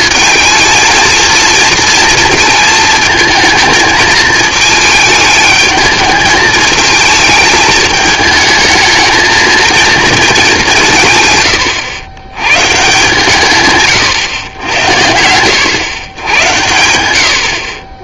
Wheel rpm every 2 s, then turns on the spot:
230, 220, 220, 220, 220, 190, 120, 90, 90.
none